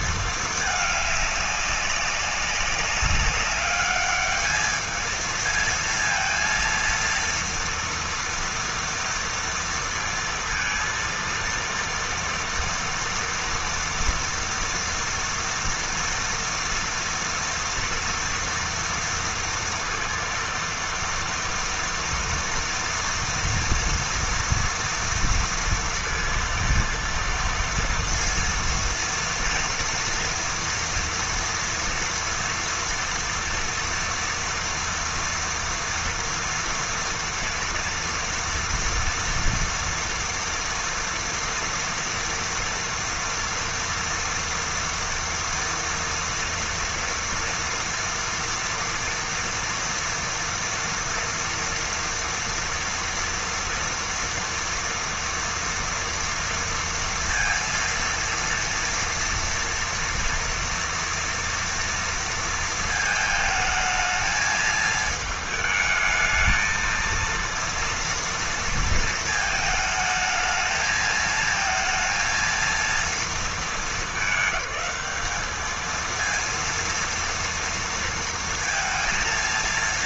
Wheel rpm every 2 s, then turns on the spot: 210, 200, 210, 230, 230, 230, 230, 230, 240, 230, 230, 230, 240, 230, 230, 240, 230, 230, 230, 240, 230, 230, 230, 230, 230, 240, 240, 230, 230, 230, 230, 230, 220, 220, 230, 220, 230, 210, 230, 230.
none